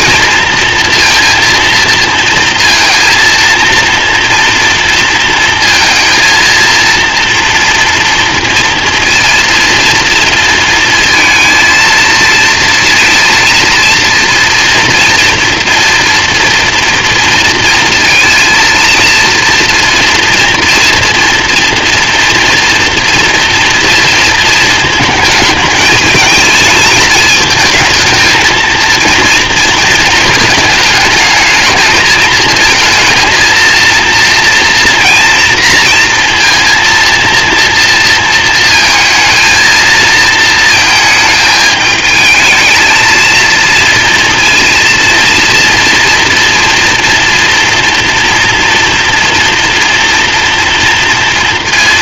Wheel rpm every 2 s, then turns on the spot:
230, 230, 230, 230, 230, 230, 230, 230, 230, 230, 230, 230, 230, 220, 230, 220, 230, 230, 230, 230, 230, 220, 230, 230, 240, 230.
none